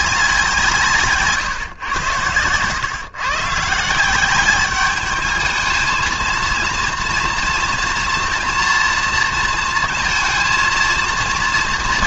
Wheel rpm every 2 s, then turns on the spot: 150, 120, 210, 230, 230, 230.
none